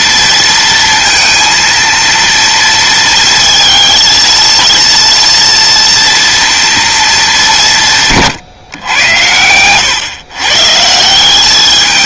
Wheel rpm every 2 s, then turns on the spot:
230, 230, 230, 230, 110, 150.
none